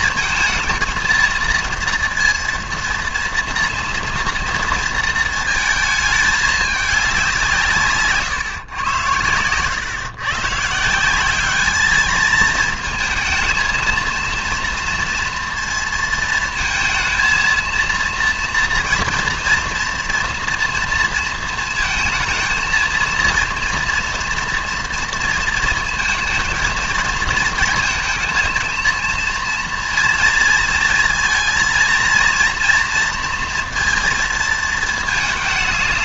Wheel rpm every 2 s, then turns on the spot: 220, 230, 230, 210, 130, 140, 220, 230, 220, 230, 230, 230, 230, 230, 230, 230, 230, 230.
none